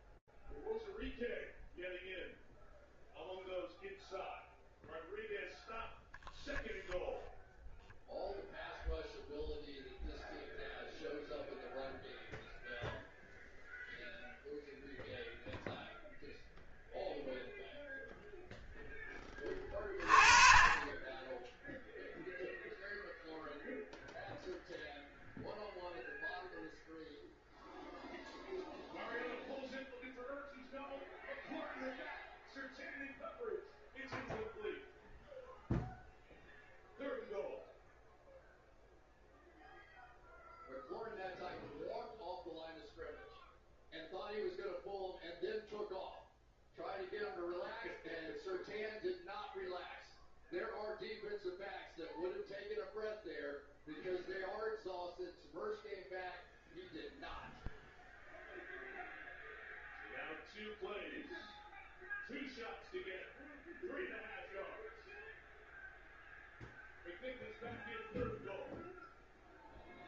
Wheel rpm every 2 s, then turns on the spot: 0, 0, 0, 0, 0, 0, 0, 0, 0, 20, 10, 0, 0, 0, 0, 0, 0, 0, 0, 0, 0, 0, 0, 0, 0, 0, 0, 0, 0, 0, 0, 0, 0, 0, 0.
none